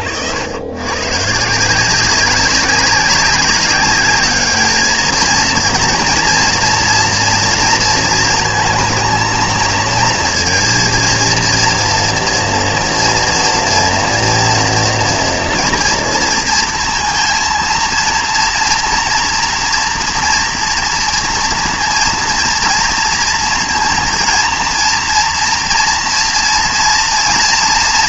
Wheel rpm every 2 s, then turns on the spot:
110, 190, 210, 230, 230, 230, 230, 230, 230, 230, 230, 230, 230, 230.
none